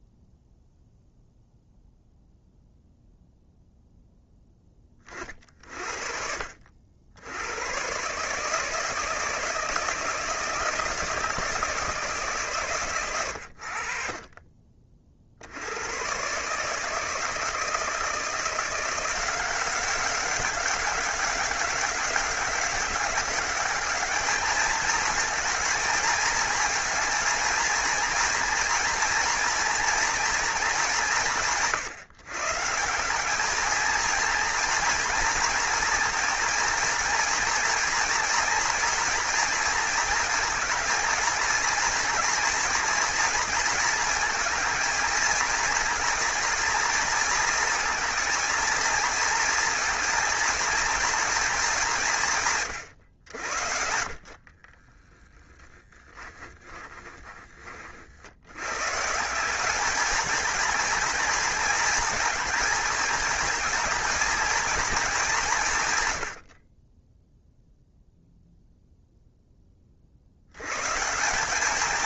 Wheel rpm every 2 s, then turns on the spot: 0, 0, 30, 80, 160, 170, 120, 50, 150, 180, 190, 200, 220, 220, 240, 200, 180, 230, 230, 230, 220, 230, 230, 230, 230, 220, 110, 20, 20, 130, 230, 220, 220, 20, 0, 140.
54-58